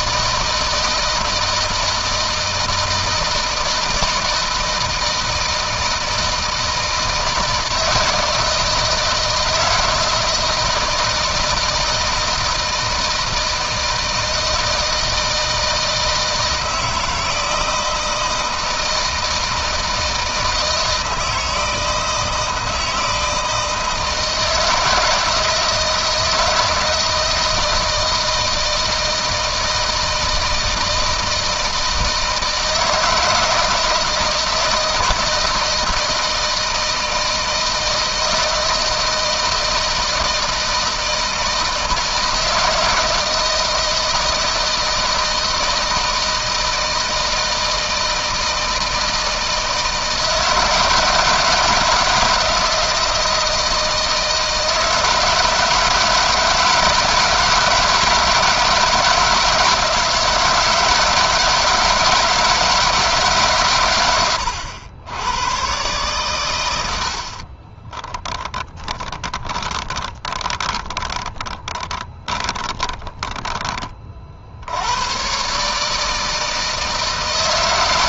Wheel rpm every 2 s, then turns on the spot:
160, 160, 160, 160, 160, 160, 160, 160, 160, 160, 160, 160, 160, 170, 160, 160, 160, 160, 160, 160, 160, 170, 160, 160, 160, 170, 160, 160, 160, 160, 160, 160, 100, 90, 10, 10, 20, 80, 160.
68-74